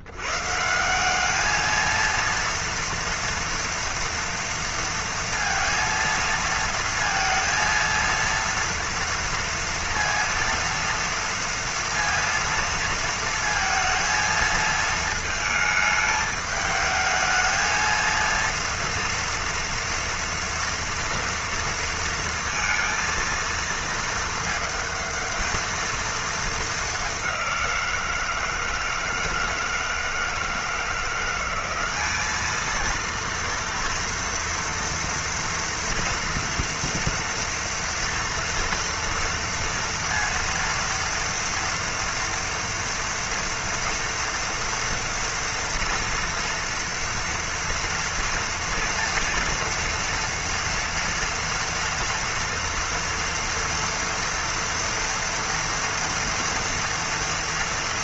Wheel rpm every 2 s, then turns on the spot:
120, 230, 230, 230, 230, 230, 230, 220, 210, 230, 230, 230, 220, 220, 170, 160, 210, 230, 230, 230, 230, 230, 230, 230, 240, 230, 230, 230, 230.
none